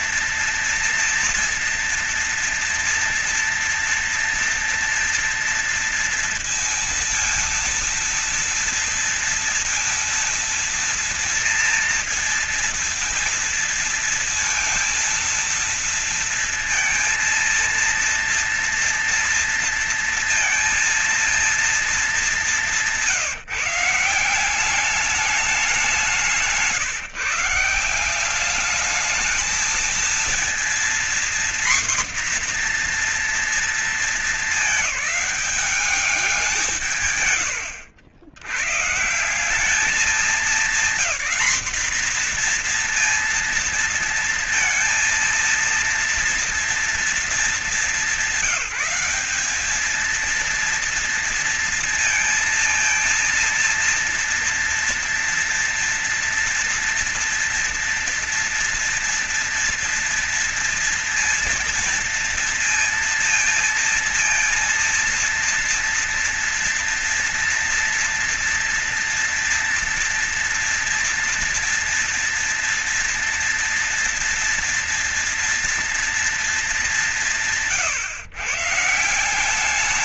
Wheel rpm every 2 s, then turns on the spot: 230, 230, 230, 230, 230, 230, 230, 230, 230, 230, 230, 180, 200, 180, 210, 240, 240, 210, 160, 140, 230, 240, 230, 230, 200, 230, 230, 230, 240, 230, 230, 230, 230, 230, 230, 230, 230, 240, 190, 160.
none